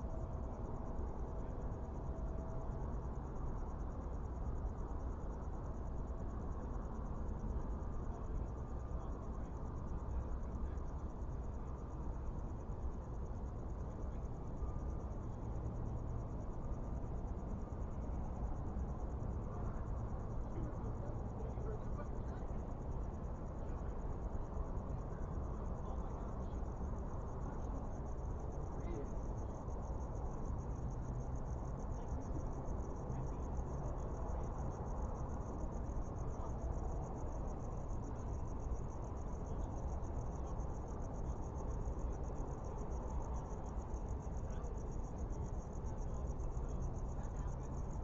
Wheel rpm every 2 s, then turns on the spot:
0, 0, 0, 0, 0, 0, 0, 0, 0, 0, 0, 0, 0, 0, 0, 0, 0, 0, 0, 0, 0, 0, 0, 0.
none